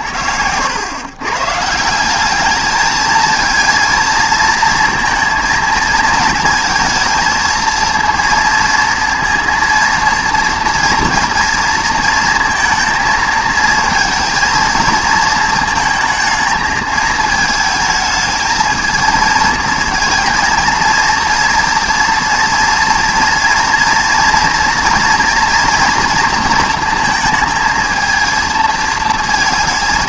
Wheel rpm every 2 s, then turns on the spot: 90, 220, 230, 230, 230, 230, 230, 230, 220, 220, 230, 230, 230, 230, 230.
none